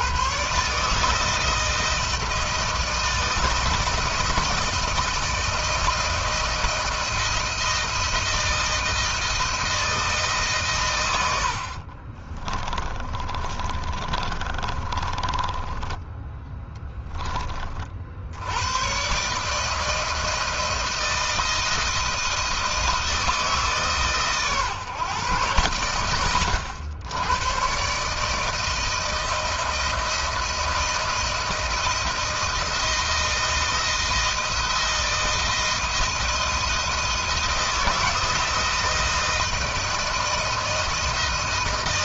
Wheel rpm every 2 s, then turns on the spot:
140, 160, 170, 170, 170, 120, 30, 30, 10, 100, 160, 160, 130, 90, 160, 160, 160, 160, 160, 160, 160.
12-16